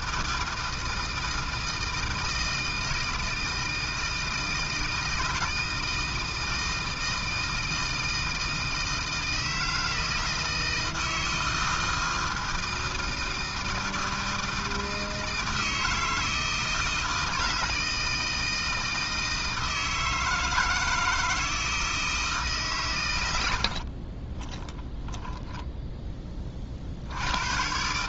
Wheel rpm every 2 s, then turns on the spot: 160, 160, 160, 160, 160, 160, 160, 160, 160, 160, 160, 140, 10, 50.
24-26